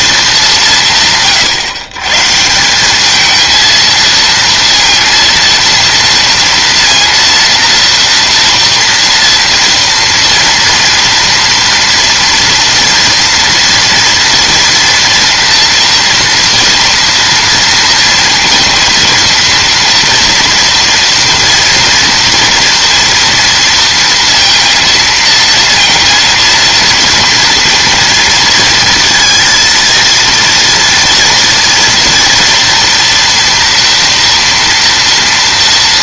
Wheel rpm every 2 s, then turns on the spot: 180, 180, 230, 230, 230, 230, 230, 230, 230, 230, 230, 240, 230, 230, 230, 230, 230, 230.
none